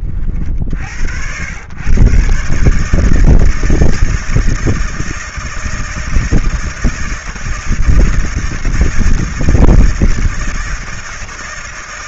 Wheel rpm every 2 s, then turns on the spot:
60, 150, 160, 160, 160, 160.
none